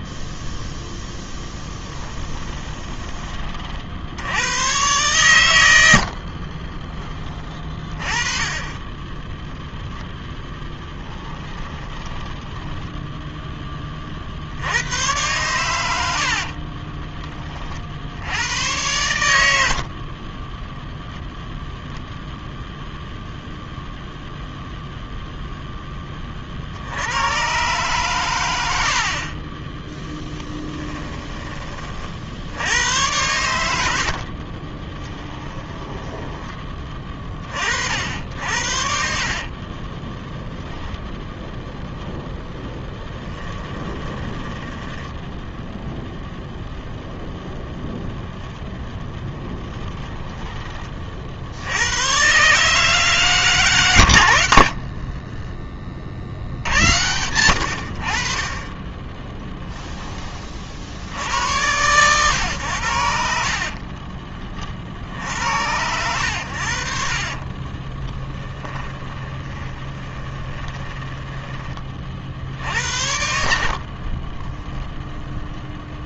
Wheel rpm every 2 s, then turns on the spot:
10, 20, 110, 30, 30, 10, 10, 90, 20, 100, 0, 0, 0, 70, 70, 10, 90, 20, 20, 60, 0, 0, 10, 0, 10, 20, 150, 60, 80, 20, 60, 90, 60, 60, 10, 20, 70, 0.
2-4 8-14 16-18 30-32 34-36 38-40 44-46 54-56 68-72